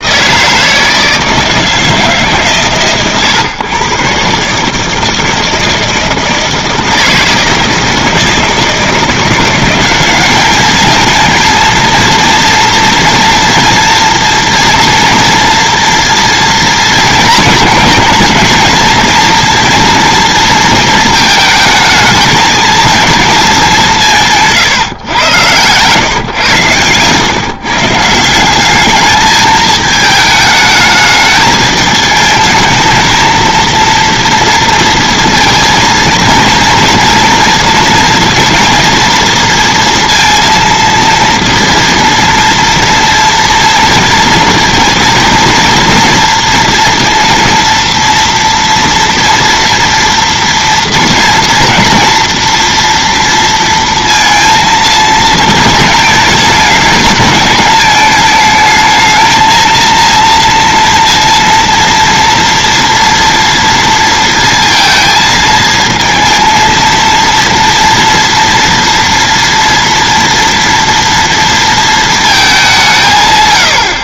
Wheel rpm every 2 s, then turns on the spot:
160, 140, 140, 160, 160, 220, 230, 230, 230, 230, 230, 220, 140, 120, 190, 210, 220, 230, 230, 230, 230, 230, 230, 230, 230, 240, 230, 230, 220, 220, 230, 230, 230, 230, 230, 230, 200.
none